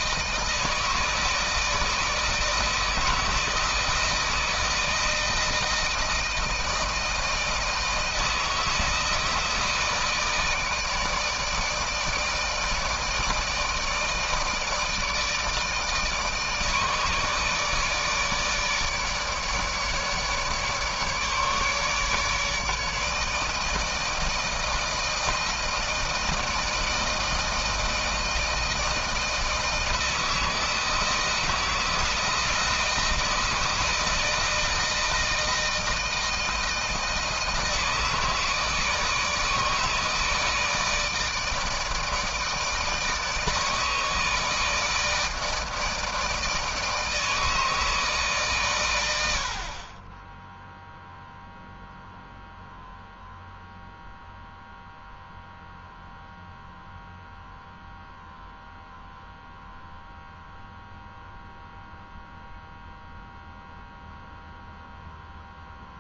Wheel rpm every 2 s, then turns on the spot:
160, 160, 160, 160, 160, 160, 160, 160, 150, 150, 150, 150, 160, 160, 160, 170, 160, 160, 160, 160, 160, 160, 160, 160, 100, 0, 0, 0, 0, 0, 0, 0, 0.
none